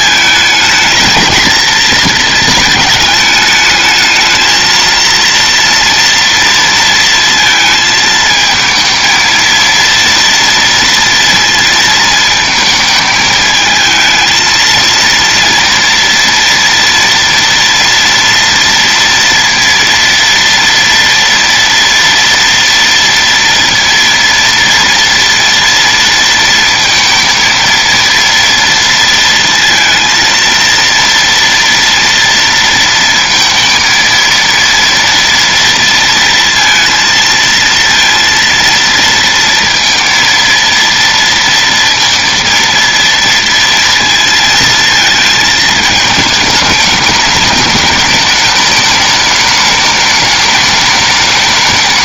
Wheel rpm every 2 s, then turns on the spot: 220, 220, 220, 230, 220, 230, 220, 230, 230, 230, 230, 230, 230, 230, 230, 230, 230, 230, 230, 230, 230, 230, 230, 210, 210, 210.
none